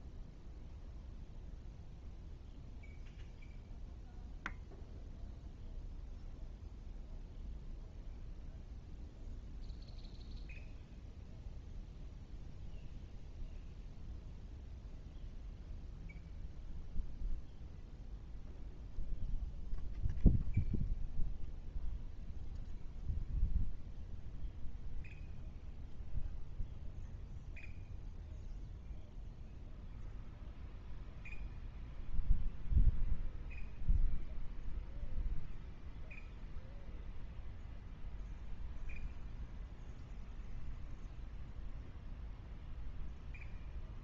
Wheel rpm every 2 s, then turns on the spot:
0, 0, 0, 0, 0, 0, 0, 0, 0, 0, 0, 0, 0, 0, 0, 0, 0, 0, 0, 0, 0, 0.
none